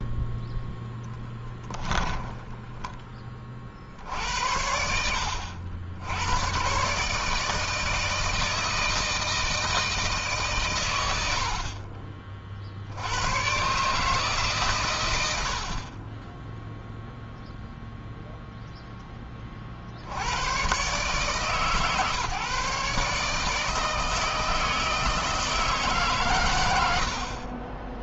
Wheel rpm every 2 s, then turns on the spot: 10, 20, 80, 130, 160, 100, 70, 120, 0, 0, 130, 150, 160, 100.
none